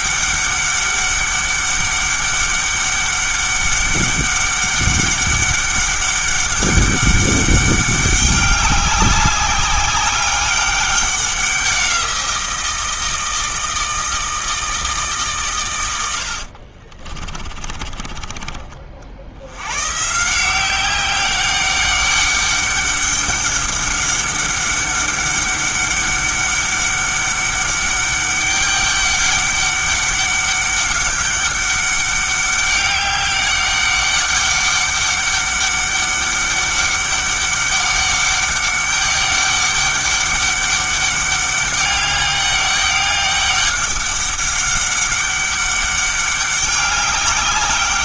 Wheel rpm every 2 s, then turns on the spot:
200, 200, 200, 200, 200, 200, 170, 160, 60, 40, 180, 200, 200, 200, 200, 200, 200, 200, 200, 200, 200, 200, 200, 200.
16-18